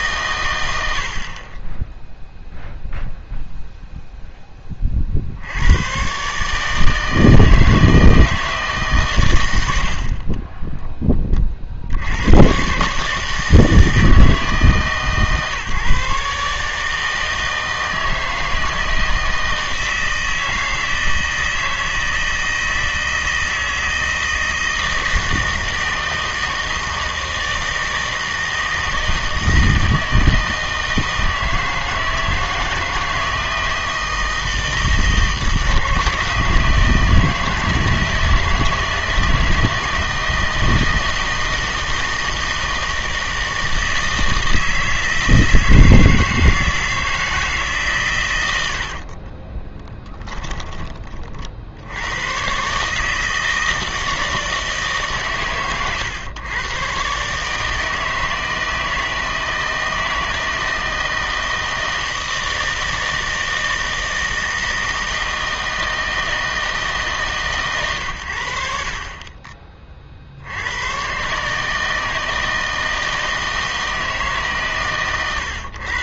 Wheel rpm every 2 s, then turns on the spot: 90, 0, 30, 150, 150, 10, 130, 150, 150, 160, 160, 160, 160, 160, 160, 160, 160, 160, 160, 160, 160, 160, 160, 160, 70, 20, 140, 160, 120, 160, 160, 160, 160, 160, 60, 100, 160, 140.
none